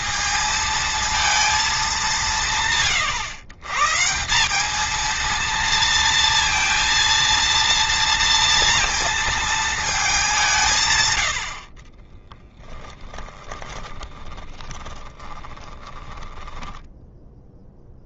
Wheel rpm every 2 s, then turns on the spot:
230, 150, 220, 230, 230, 140, 10, 20, 10.
12-18